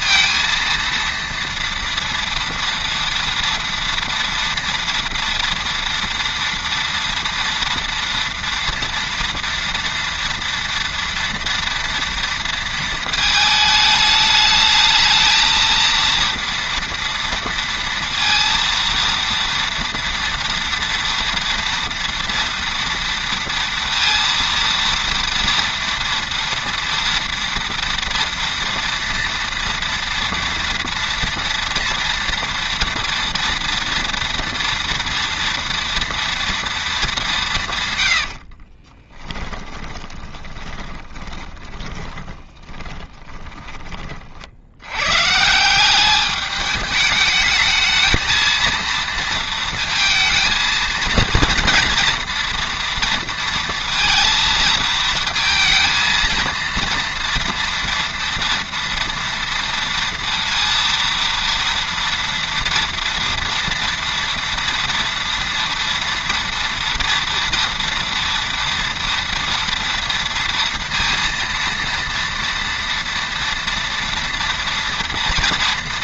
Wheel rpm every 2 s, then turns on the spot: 230, 230, 230, 240, 240, 230, 230, 210, 230, 230, 230, 230, 230, 230, 230, 230, 230, 230, 230, 40, 20, 20, 60, 210, 220, 220, 230, 230, 230, 230, 230, 230, 230, 230, 230, 230, 230, 230.
38-44